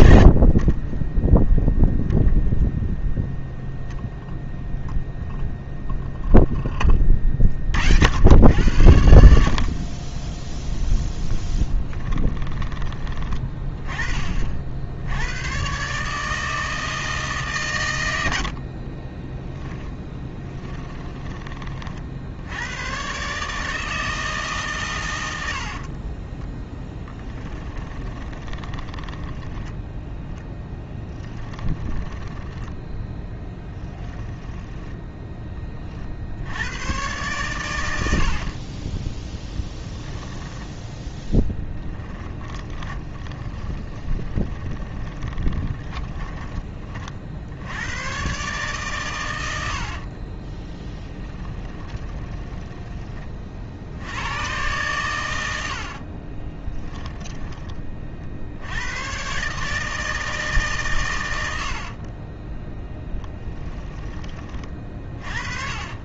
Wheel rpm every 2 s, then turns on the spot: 20, 0, 0, 20, 70, 10, 20, 80, 160, 30, 20, 120, 120, 10, 20, 10, 10, 10, 100, 20, 10, 20, 20, 30, 130, 10, 20, 110, 20, 100, 140, 10, 30.
18-22 26-32 38-40 42-46 50-52 56-58 62-66